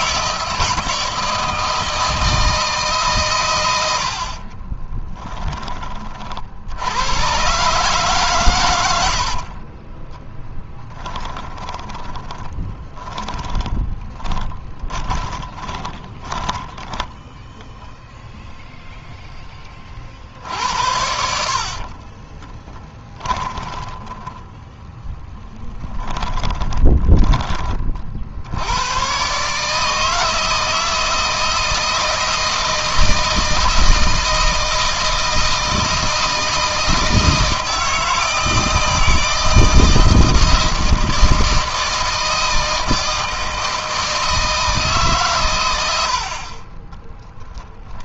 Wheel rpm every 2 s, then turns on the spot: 160, 150, 20, 90, 90, 20, 10, 20, 10, 0, 70, 20, 10, 20, 110, 160, 160, 160, 160, 160, 160, 160, 140, 30.
4-6 8-16 20-28 46-48